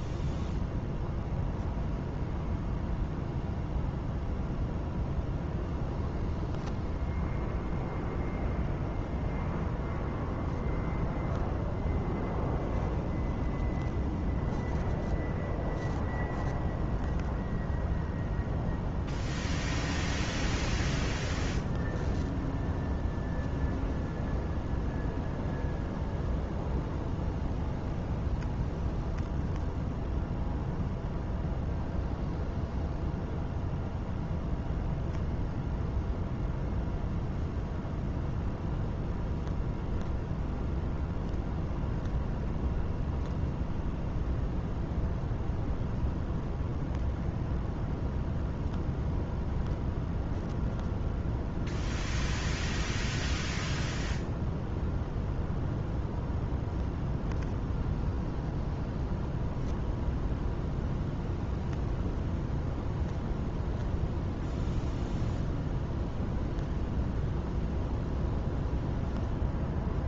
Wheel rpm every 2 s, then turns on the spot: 0, 0, 0, 0, 0, 0, 0, 0, 0, 0, 0, 0, 0, 0, 0, 0, 0, 0, 0, 0, 0, 0, 0, 0, 0, 0, 0, 0, 0, 0, 0, 0, 0, 0, 0.
none